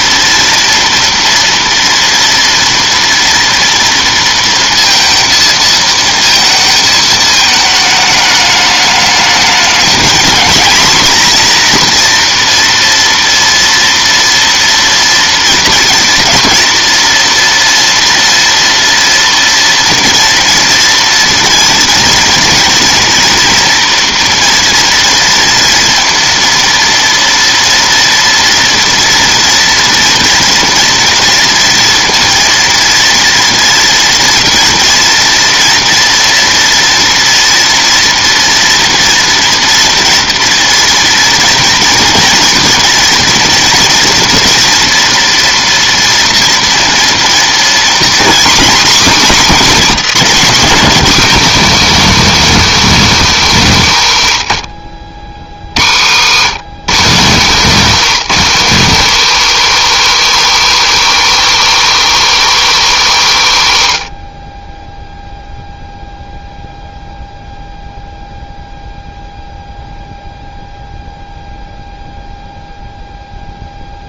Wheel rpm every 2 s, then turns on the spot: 230, 230, 230, 220, 210, 230, 230, 230, 230, 230, 230, 230, 230, 230, 230, 230, 230, 230, 230, 230, 230, 230, 230, 230, 250, 210, 210, 60, 150, 170, 170, 160, 10, 0, 0, 0, 0.
none